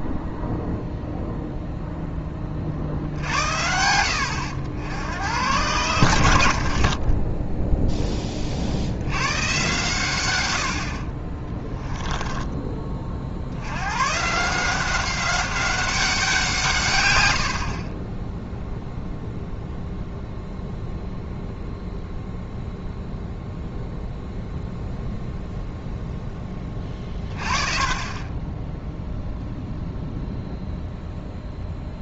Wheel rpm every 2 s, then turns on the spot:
0, 40, 80, 60, 50, 80, 30, 170, 160, 0, 0, 0, 0, 10, 10, 0.
6-8